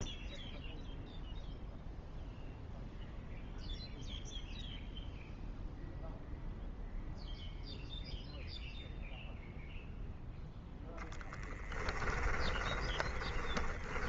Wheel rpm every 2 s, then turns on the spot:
0, 0, 0, 0, 0, 0, 20.
12-14